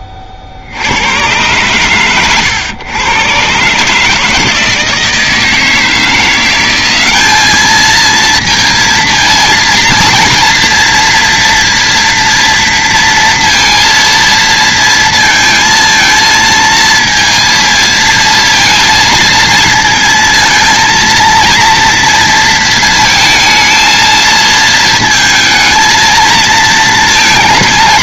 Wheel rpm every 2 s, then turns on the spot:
70, 110, 160, 190, 230, 230, 230, 230, 220, 230, 230, 220, 220, 220.
none